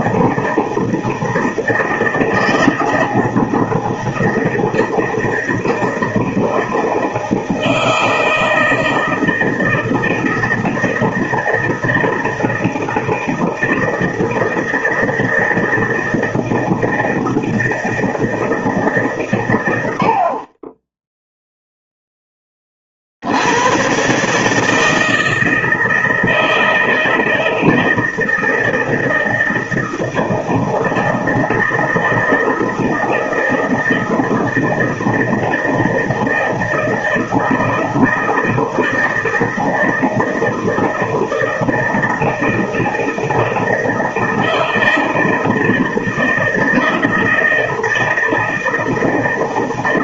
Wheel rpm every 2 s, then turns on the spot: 160, 160, 160, 160, 160, 160, 160, 160, 160, 160, 40, 40, 160, 160, 160, 160, 160, 160, 160, 160, 160, 160, 160, 160, 160.
none